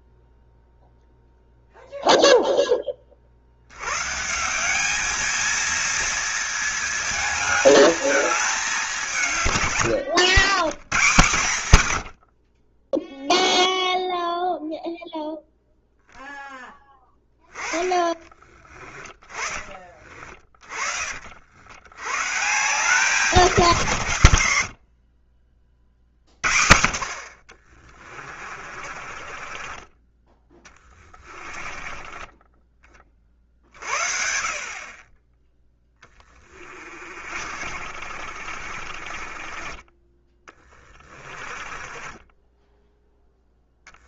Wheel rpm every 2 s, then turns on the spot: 0, 10, 180, 230, 210, 110, 40, 0, 10, 20, 30, 140, 80, 60, 30, 20, 20, 40, 20, 40, 20, 10.
18-20 28-32 36-44